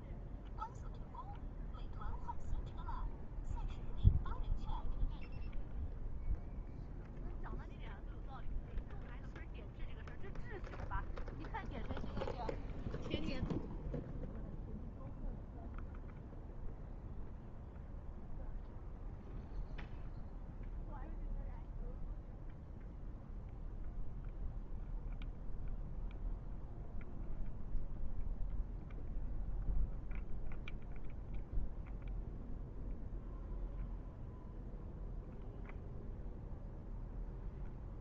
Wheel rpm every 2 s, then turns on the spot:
0, 0, 0, 0, 0, 0, 0, 0, 0, 0, 0, 0, 0, 0, 0, 0, 0, 0, 0.
none